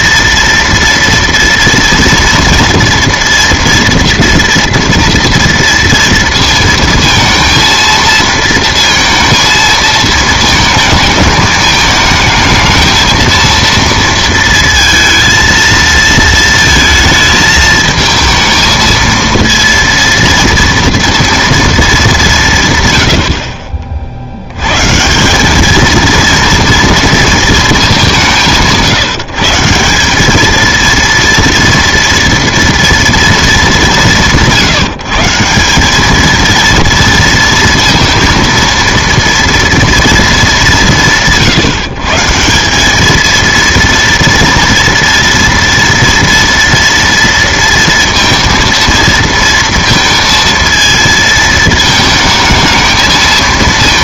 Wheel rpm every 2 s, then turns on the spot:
230, 230, 230, 230, 230, 220, 220, 230, 220, 230, 230, 140, 120, 230, 170, 230, 230, 170, 230, 230, 200, 190, 230, 230, 230, 230, 220.
none